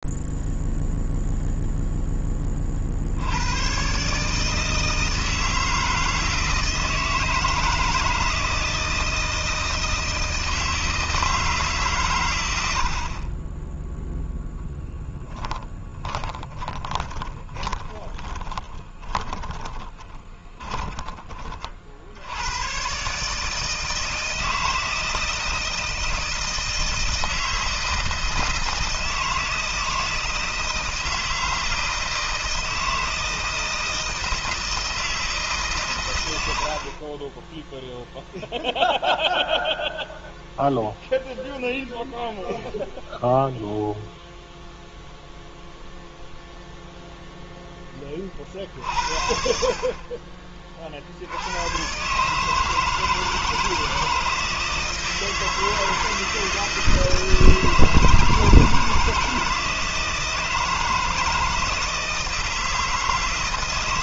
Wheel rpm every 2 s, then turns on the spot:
0, 10, 140, 160, 160, 160, 120, 0, 20, 20, 20, 120, 160, 160, 160, 160, 160, 160, 50, 0, 0, 0, 0, 0, 60, 50, 160, 160, 160, 160, 160, 160.
16-20